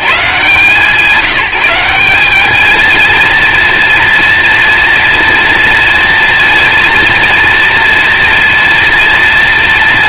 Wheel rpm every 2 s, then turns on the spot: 110, 190, 240, 230, 230.
none